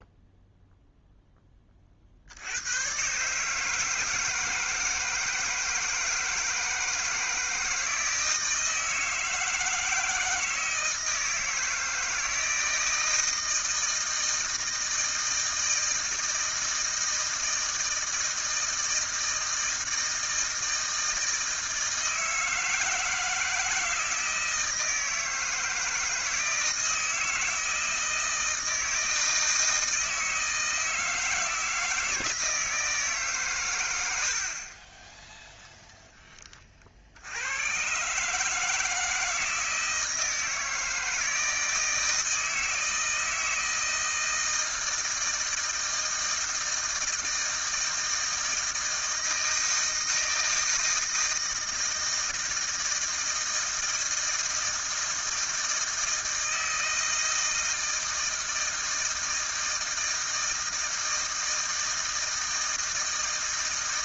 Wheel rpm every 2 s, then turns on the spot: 0, 90, 160, 160, 160, 160, 160, 160, 160, 160, 160, 160, 160, 160, 160, 160, 160, 50, 30, 160, 160, 160, 160, 160, 160, 160, 160, 160, 160, 160, 160, 160.
none